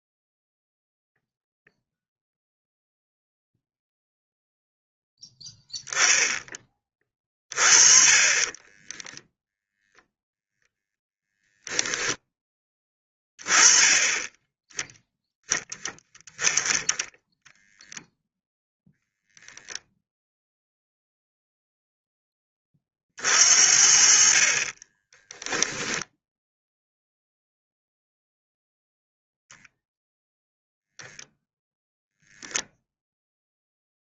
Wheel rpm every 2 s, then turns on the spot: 0, 0, 0, 0, 30, 0, 10, 10, 10, 0, 0, 20, 40, 0, 0, 0, 0.
none